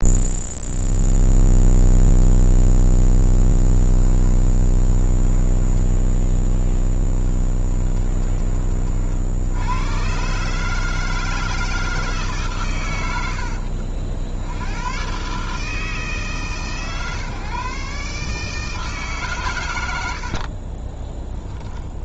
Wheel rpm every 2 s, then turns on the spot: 0, 0, 20, 10, 30, 150, 140, 80, 140, 150, 30.
4-8 20-22